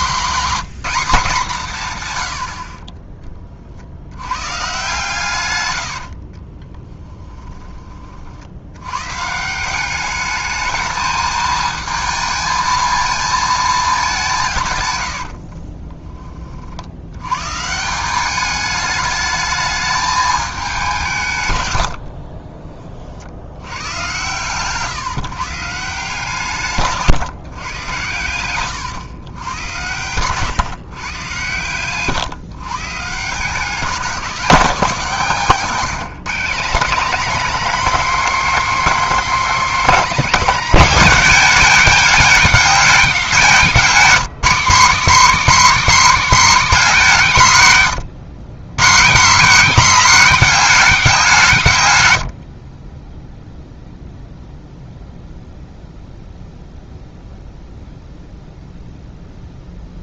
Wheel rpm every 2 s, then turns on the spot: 210, 30, 140, 20, 120, 220, 220, 120, 80, 210, 190, 40, 140, 150, 110, 120, 140, 220, 210, 260, 230, 200, 200, 210, 150, 200, 20, 0, 0, 0.
6-8 14-16 26-28